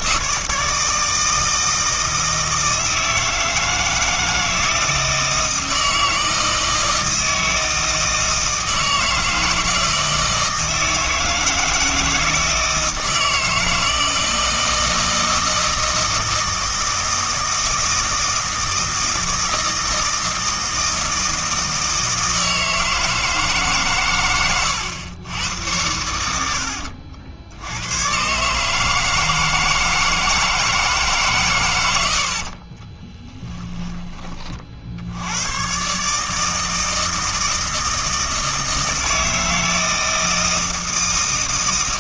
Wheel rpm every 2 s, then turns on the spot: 160, 160, 160, 160, 160, 160, 160, 160, 160, 160, 160, 160, 110, 70, 150, 160, 40, 60, 160, 160, 160.
26-28 32-34